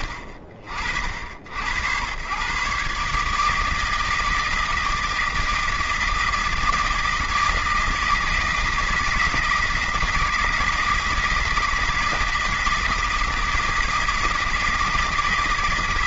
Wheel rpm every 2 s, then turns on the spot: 60, 130, 160, 160, 160, 160, 160, 160.
none